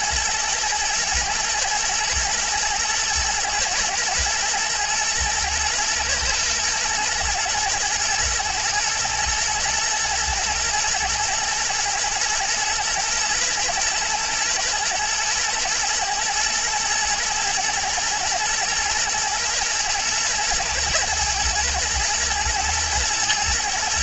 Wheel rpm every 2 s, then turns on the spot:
110, 120, 120, 110, 110, 110, 120, 110, 120, 120, 120, 120.
none